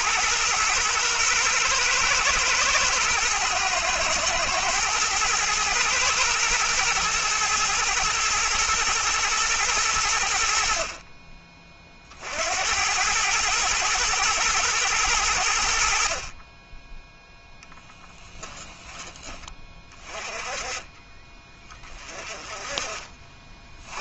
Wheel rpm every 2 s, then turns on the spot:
110, 120, 110, 110, 120, 60, 80, 110, 20, 20, 30, 30.
22-24